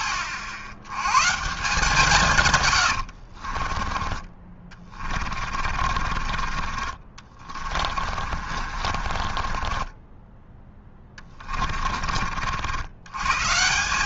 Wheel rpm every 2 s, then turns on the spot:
70, 110, 30, 30, 40, 10, 70.
2-10